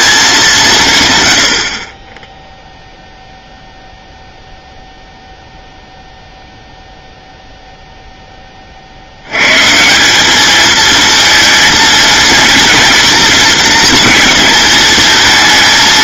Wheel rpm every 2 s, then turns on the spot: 180, 0, 0, 0, 30, 210, 230, 220.
none